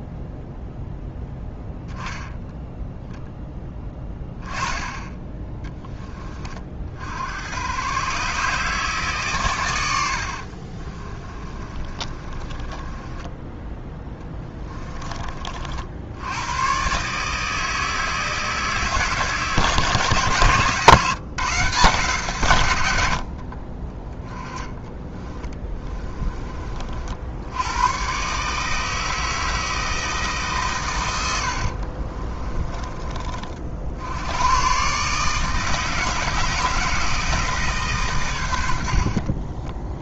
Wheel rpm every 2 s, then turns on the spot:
0, 0, 20, 50, 140, 30, 20, 20, 130, 150, 140, 80, 20, 50, 150, 120, 20, 120, 160, 70.
10-16 24-26 32-34